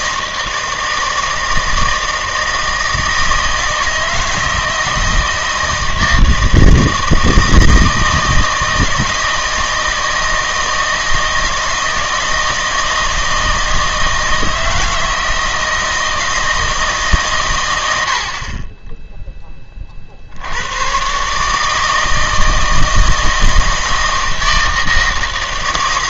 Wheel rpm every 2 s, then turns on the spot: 160, 160, 160, 160, 160, 160, 160, 160, 160, 20, 110, 160, 160.
none